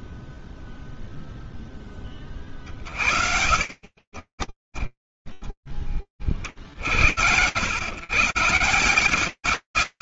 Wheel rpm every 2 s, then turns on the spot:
0, 40, 30, 40, 140.
2-6